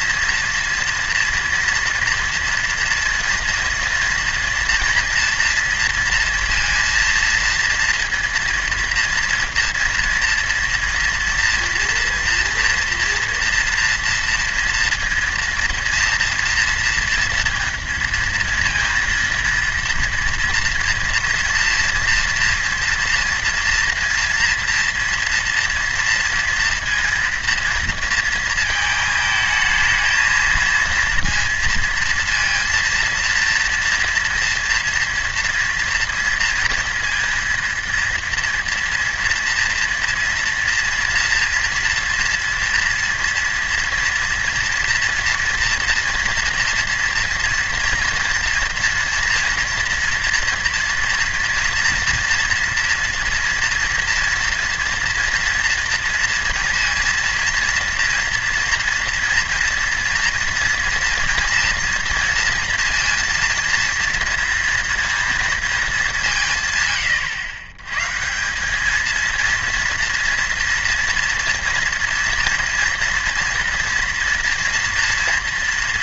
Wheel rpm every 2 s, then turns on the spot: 230, 230, 230, 230, 230, 230, 230, 230, 230, 230, 230, 230, 240, 230, 230, 220, 230, 230, 230, 230, 230, 230, 230, 230, 240, 240, 230, 240, 230, 230, 240, 230, 230, 160, 180, 230, 230, 240.
none